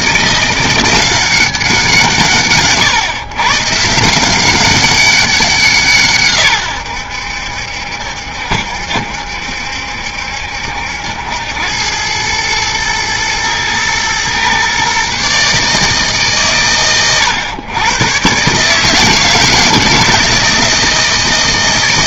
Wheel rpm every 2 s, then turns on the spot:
180, 120, 190, 100, 70, 70, 110, 130, 130, 150, 160.
none